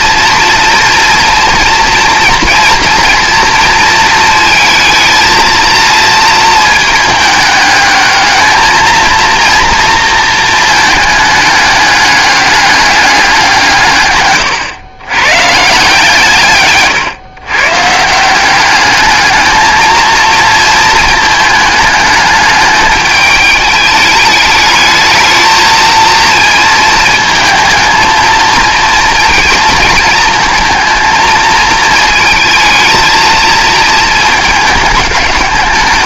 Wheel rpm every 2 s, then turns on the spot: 230, 230, 230, 220, 230, 220, 200, 120, 140, 200, 220, 210, 210, 220, 230, 220, 220, 210.
none